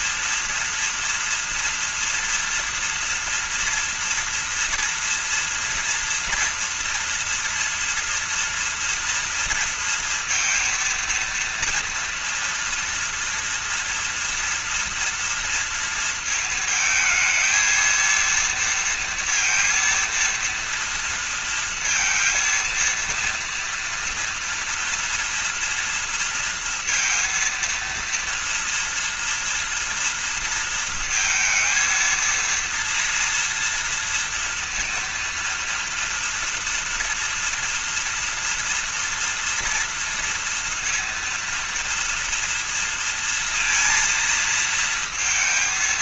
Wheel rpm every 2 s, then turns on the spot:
230, 230, 240, 230, 230, 230, 240, 230, 220, 230, 230, 230, 230, 230, 230, 230, 230, 230, 230, 230, 230, 230, 230.
none